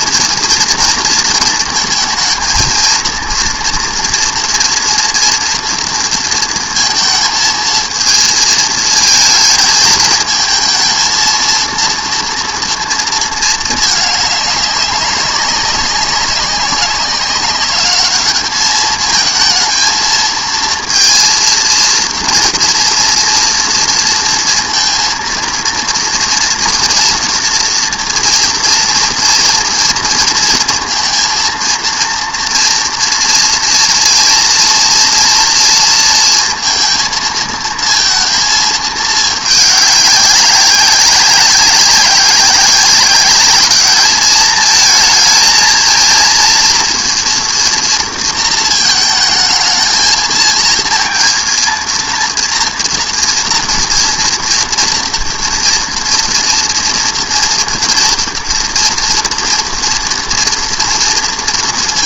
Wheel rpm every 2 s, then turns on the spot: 230, 230, 230, 230, 220, 220, 230, 200, 190, 210, 230, 230, 230, 230, 230, 230, 230, 230, 230, 220, 190, 190, 220, 230, 230, 230, 230, 230, 230, 230, 230.
none